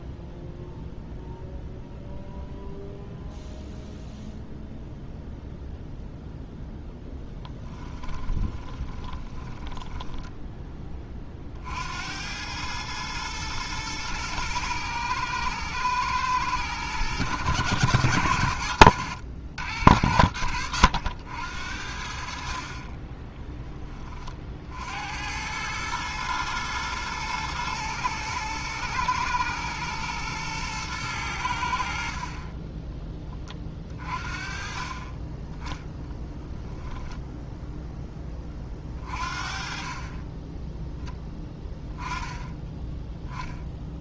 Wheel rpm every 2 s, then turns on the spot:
0, 0, 0, 0, 20, 20, 110, 110, 110, 90, 90, 40, 70, 120, 110, 110, 20, 30, 0, 30, 10, 10.
8-10